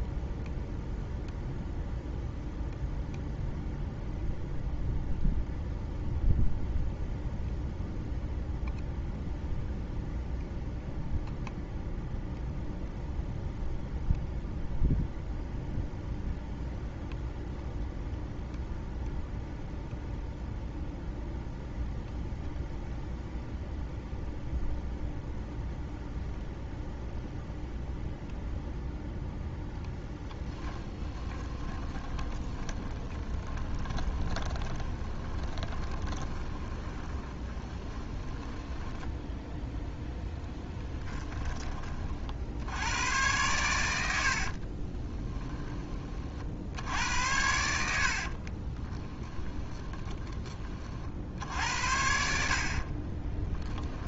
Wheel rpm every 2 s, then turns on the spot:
0, 0, 0, 0, 0, 0, 0, 0, 0, 0, 0, 0, 0, 0, 0, 20, 20, 20, 20, 10, 10, 80, 30, 80, 20, 40, 50.
30-42 44-46 48-50 52-54